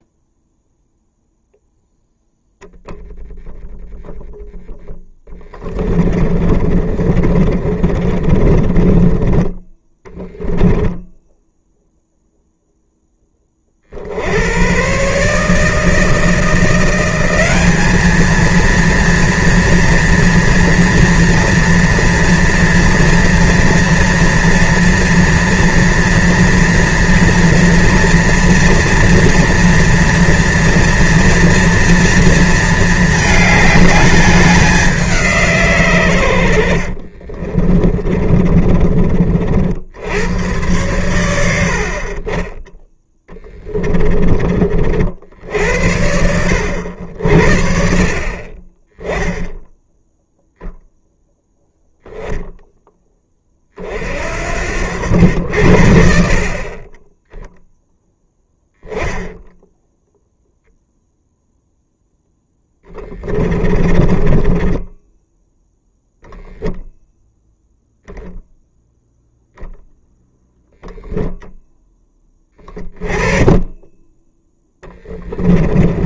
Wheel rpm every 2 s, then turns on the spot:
0, 0, 0, 30, 30, 0, 10, 130, 180, 230, 230, 230, 230, 230, 230, 230, 220, 190, 70, 40, 100, 10, 50, 80, 20, 0, 10, 70, 20, 10, 0, 10, 10, 0, 10, 0, 20, 10.
6-10 36-38 42-44 62-66 74-76